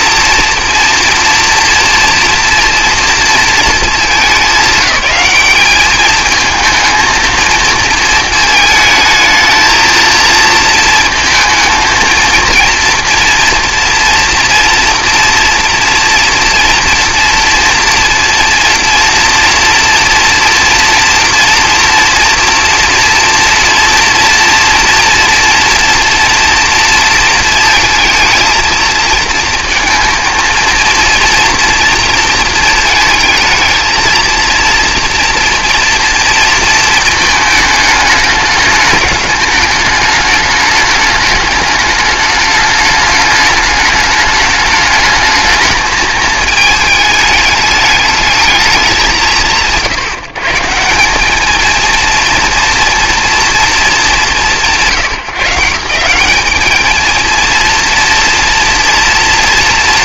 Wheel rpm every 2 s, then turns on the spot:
230, 230, 200, 220, 220, 220, 230, 230, 230, 230, 230, 240, 230, 230, 220, 230, 220, 230, 230, 210, 220, 210, 210, 220, 180, 160, 230, 140, 210, 230.
none